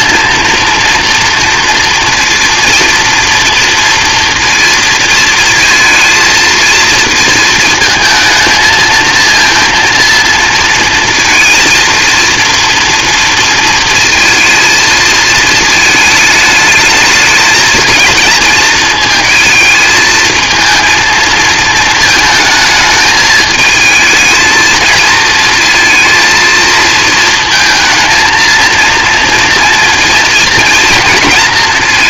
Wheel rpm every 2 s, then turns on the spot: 230, 230, 230, 230, 220, 230, 230, 220, 220, 220, 230, 220, 230, 230, 230, 230.
none